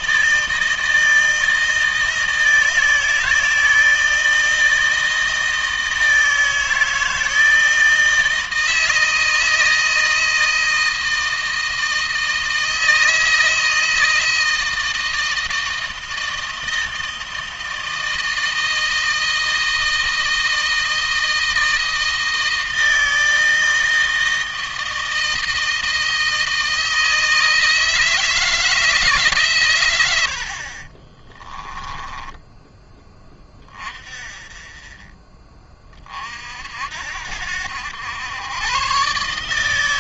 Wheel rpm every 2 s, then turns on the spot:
160, 160, 160, 160, 160, 160, 160, 160, 160, 160, 160, 160, 160, 160, 140, 30, 20, 20, 70, 130.
30-32